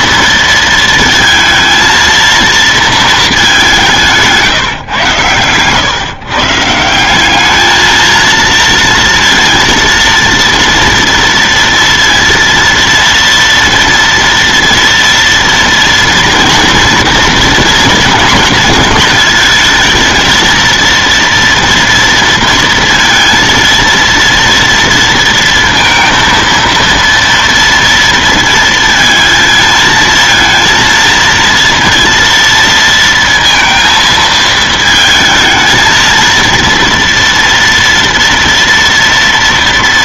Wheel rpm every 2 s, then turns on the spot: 230, 230, 150, 150, 230, 230, 230, 230, 230, 230, 220, 230, 230, 230, 230, 230, 230, 220, 230, 230.
none